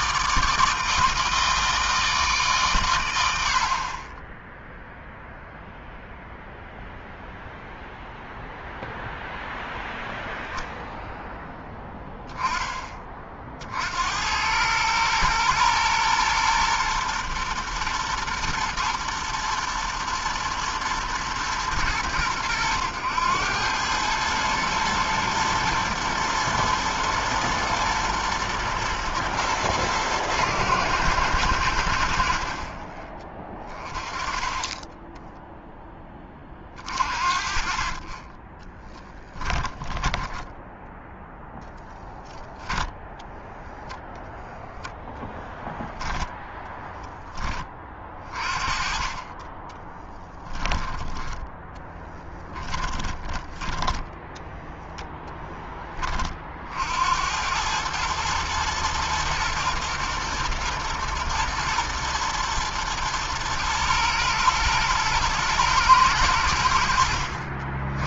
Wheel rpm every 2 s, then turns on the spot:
160, 100, 0, 0, 0, 0, 30, 110, 120, 110, 120, 100, 110, 110, 110, 110, 20, 10, 40, 10, 0, 0, 0, 10, 30, 20, 20, 0, 80, 110, 110, 120, 120, 60.
38-40 52-54